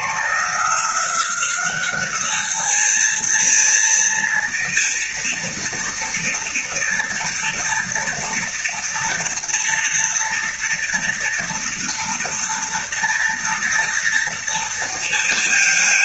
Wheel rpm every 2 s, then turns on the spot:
180, 220, 230, 240, 230, 230, 230, 230.
none